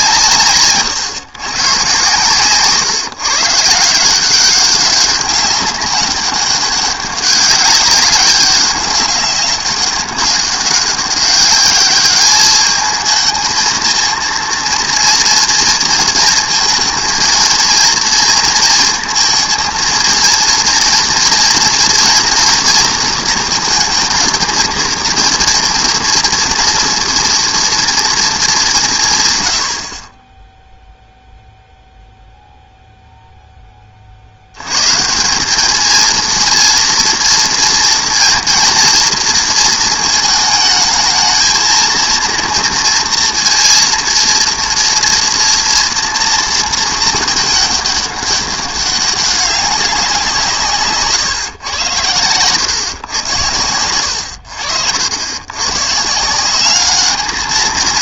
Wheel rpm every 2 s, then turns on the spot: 140, 130, 190, 200, 200, 200, 210, 230, 230, 230, 230, 230, 230, 230, 200, 0, 0, 110, 230, 230, 220, 230, 230, 230, 200, 150, 130, 80, 200.
0-2